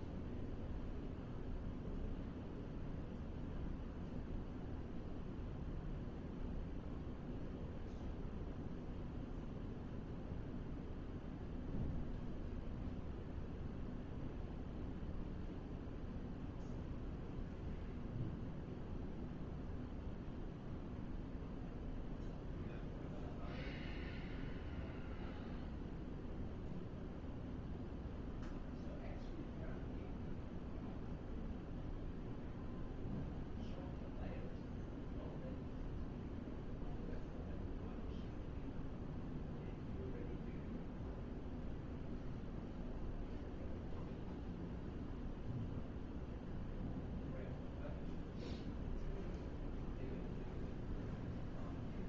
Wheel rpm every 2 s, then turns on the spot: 0, 0, 0, 0, 0, 0, 0, 0, 0, 0, 0, 0, 0, 0, 0, 0, 0, 0, 0, 0, 0, 0, 0, 0, 0, 0.
none